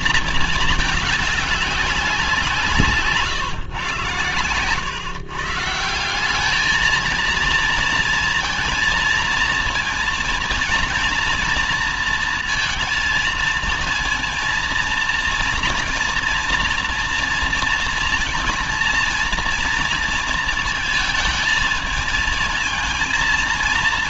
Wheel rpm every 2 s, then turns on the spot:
210, 140, 130, 220, 230, 230, 230, 230, 230, 230, 220, 230.
none